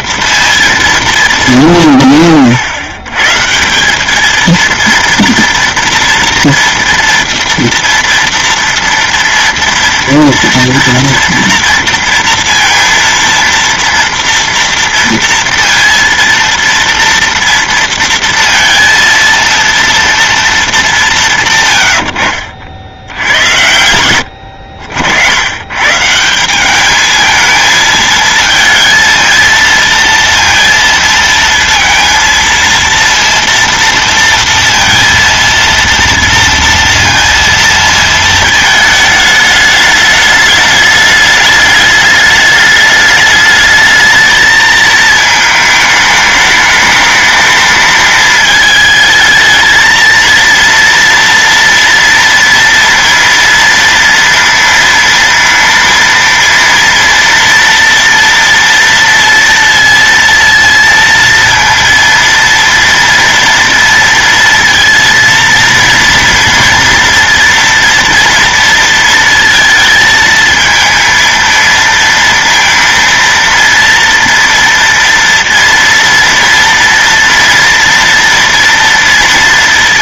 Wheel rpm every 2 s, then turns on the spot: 230, 100, 230, 230, 230, 230, 230, 230, 230, 230, 220, 60, 80, 190, 220, 230, 230, 230, 230, 220, 210, 210, 220, 210, 220, 230, 230, 230, 230, 230, 230, 230, 230, 230, 230, 220, 230, 230, 230, 230.
none